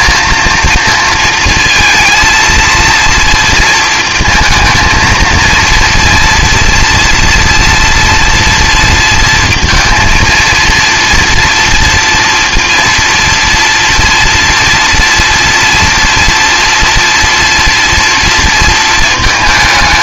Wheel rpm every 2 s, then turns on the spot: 230, 230, 220, 230, 230, 230, 230, 230, 230, 230.
none